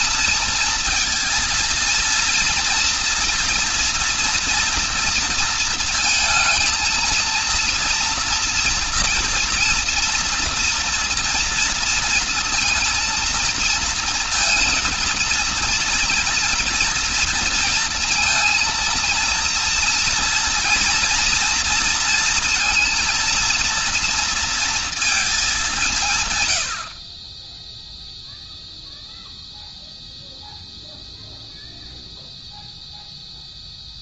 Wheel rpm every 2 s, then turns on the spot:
230, 230, 230, 230, 230, 230, 230, 230, 230, 230, 230, 230, 230, 110, 0, 0, 0.
none